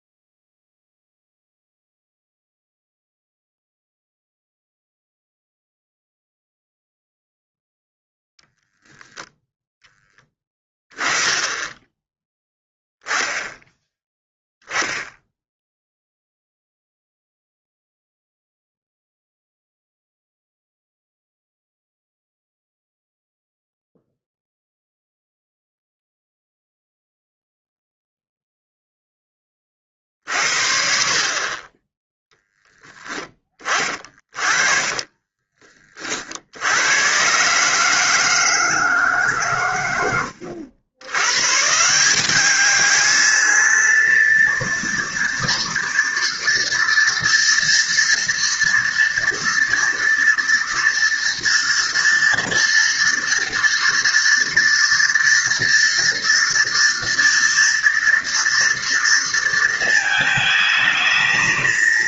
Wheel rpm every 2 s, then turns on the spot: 0, 0, 0, 0, 0, 10, 10, 10, 0, 0, 0, 0, 0, 0, 0, 60, 10, 40, 90, 160, 100, 210, 230, 230, 230, 230, 230, 230, 230, 230, 220.
34-36